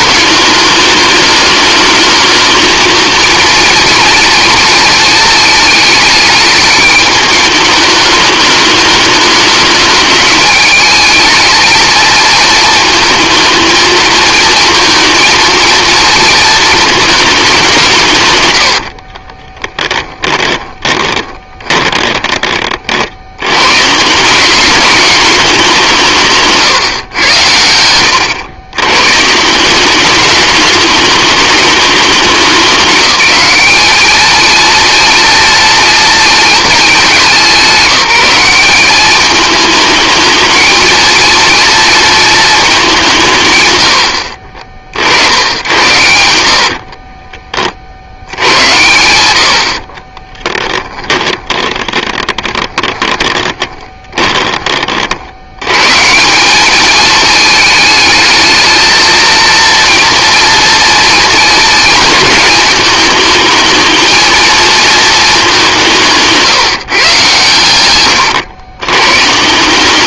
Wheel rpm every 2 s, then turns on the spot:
210, 220, 230, 210, 210, 210, 220, 230, 230, 70, 20, 50, 200, 130, 110, 210, 200, 230, 210, 200, 230, 200, 50, 30, 100, 10, 10, 40, 210, 220, 230, 220, 230, 150, 120.
18-22 46-48 50-54